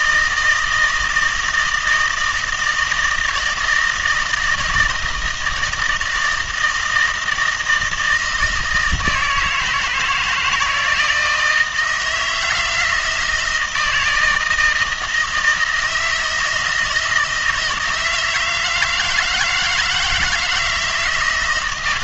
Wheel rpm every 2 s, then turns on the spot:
160, 160, 160, 160, 160, 170, 160, 160, 160, 160, 160.
none